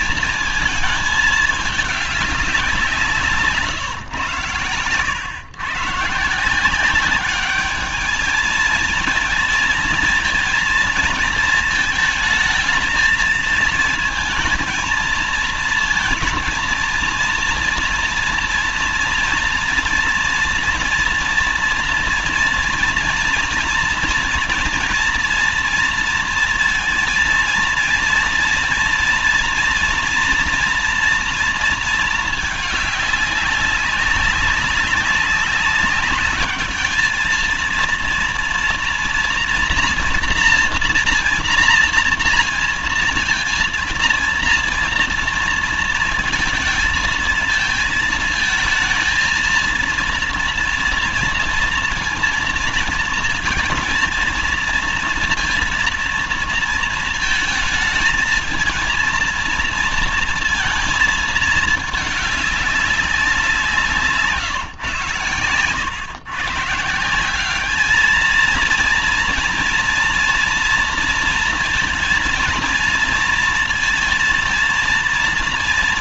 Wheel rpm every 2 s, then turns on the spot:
230, 190, 120, 170, 220, 230, 220, 220, 230, 230, 230, 230, 230, 230, 230, 230, 210, 200, 210, 230, 230, 230, 230, 230, 220, 230, 230, 230, 220, 230, 230, 200, 140, 140, 220, 230, 230, 230.
none